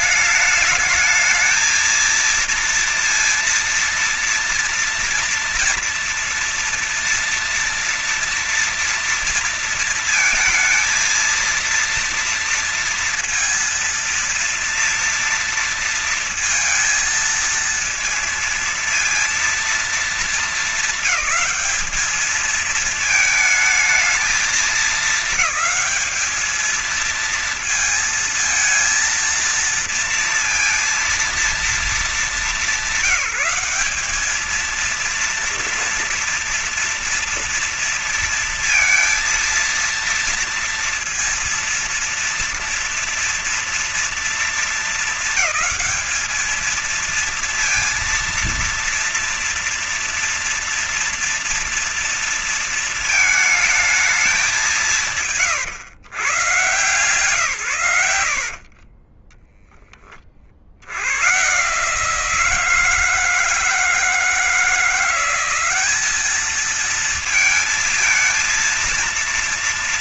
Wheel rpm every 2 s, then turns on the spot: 210, 230, 230, 230, 230, 230, 230, 230, 230, 230, 210, 210, 210, 210, 220, 230, 220, 220, 230, 230, 230, 230, 230, 220, 230, 230, 230, 200, 130, 110, 30, 150, 160, 210, 230.
none